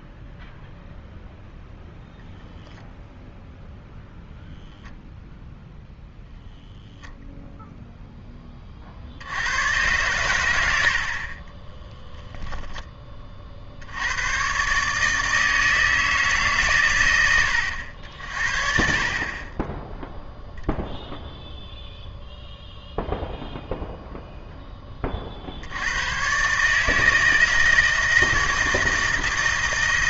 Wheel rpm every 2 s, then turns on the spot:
0, 0, 0, 0, 30, 90, 0, 130, 130, 50, 0, 0, 10, 140, 160.
none